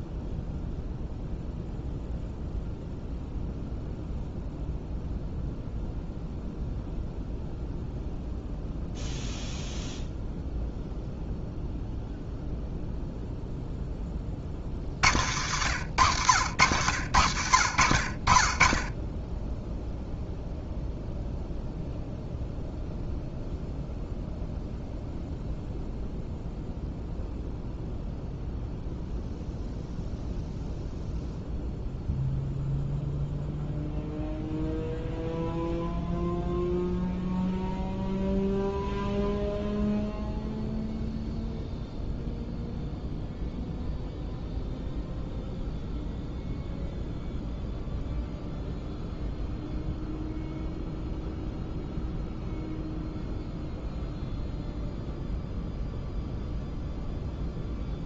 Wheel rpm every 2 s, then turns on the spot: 0, 0, 0, 0, 0, 0, 0, 80, 80, 10, 0, 0, 0, 0, 0, 0, 0, 0, 0, 0, 0, 0, 0, 0, 0, 0, 0, 0, 0.
none